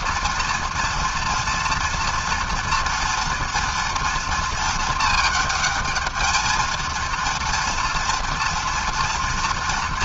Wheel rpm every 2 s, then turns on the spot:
230, 230, 220, 230, 230.
none